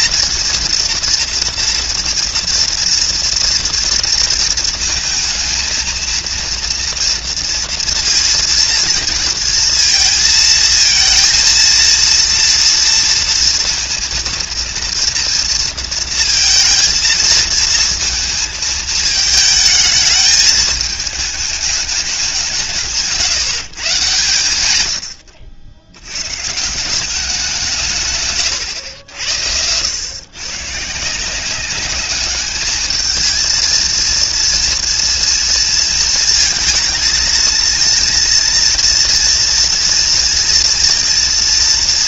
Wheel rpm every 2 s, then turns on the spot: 230, 230, 230, 230, 230, 220, 230, 230, 230, 220, 210, 160, 110, 150, 110, 120, 210, 240, 220, 230, 230.
none